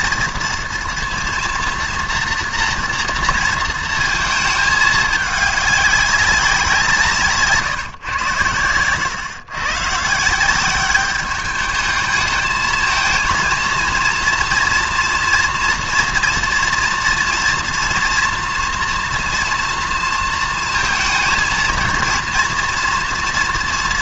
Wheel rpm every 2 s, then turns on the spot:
230, 230, 210, 170, 100, 200, 220, 230, 230, 230, 230, 240.
none